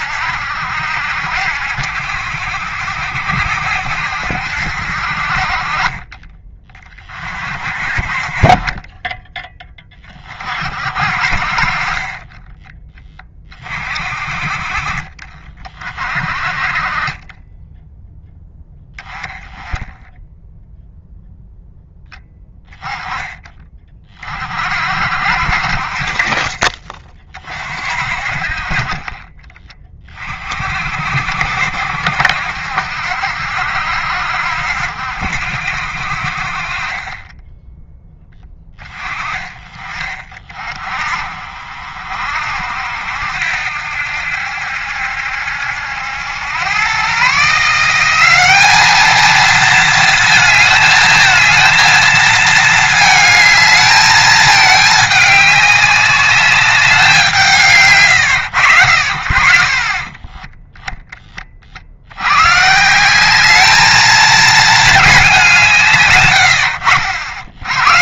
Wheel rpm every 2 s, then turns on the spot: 70, 70, 60, 20, 20, 40, 10, 30, 40, 10, 0, 10, 50, 30, 30, 60, 70, 70, 30, 20, 50, 70, 70, 110, 210, 220, 220, 210, 200, 90, 10, 160, 220, 70.
8-10